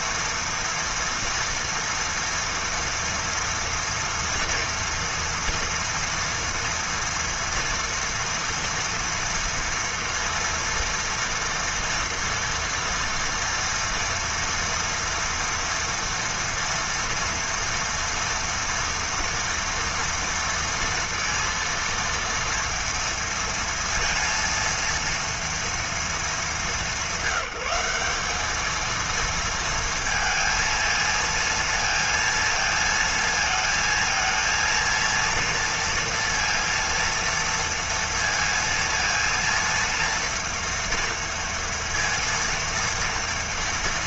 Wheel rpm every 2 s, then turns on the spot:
230, 230, 230, 230, 230, 230, 230, 230, 240, 230, 230, 230, 230, 200, 210, 230, 230, 230, 230, 230, 230, 230.
none